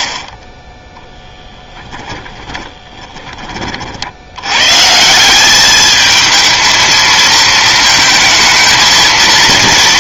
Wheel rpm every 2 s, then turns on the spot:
10, 20, 150, 220, 230.
0-4